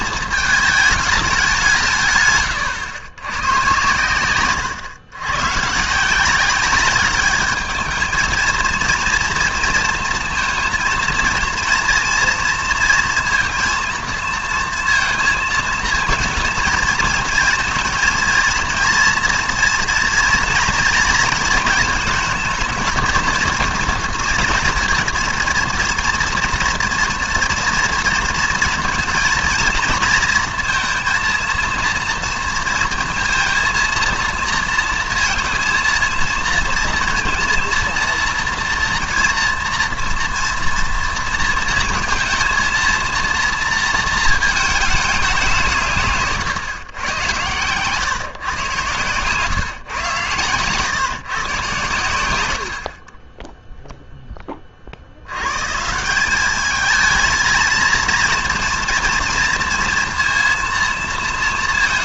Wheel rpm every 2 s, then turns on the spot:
220, 110, 110, 200, 230, 230, 230, 230, 220, 230, 230, 220, 230, 240, 230, 230, 230, 230, 230, 230, 230, 230, 220, 140, 130, 120, 70, 30, 210, 230, 230.
4-6